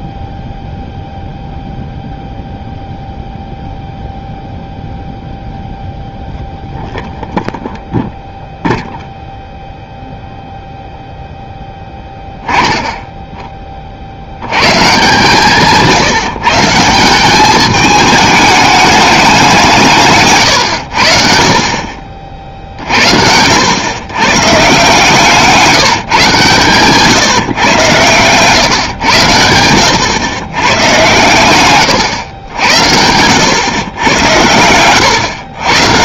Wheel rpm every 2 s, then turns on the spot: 0, 0, 0, 0, 0, 0, 10, 120, 150, 210, 100, 50, 140, 140, 130, 110, 90, 100.
none